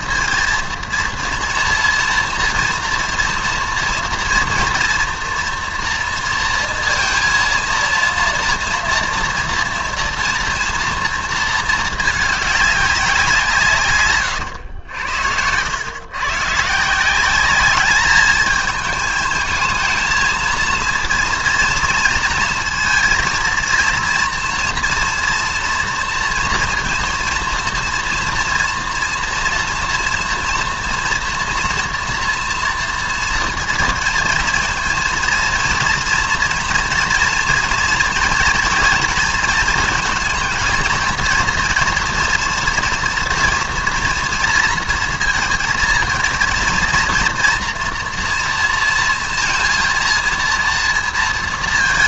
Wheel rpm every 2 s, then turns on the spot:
230, 240, 230, 230, 230, 230, 190, 80, 160, 220, 230, 230, 230, 230, 230, 230, 230, 230, 230, 230, 230, 230, 230, 230, 230, 230.
none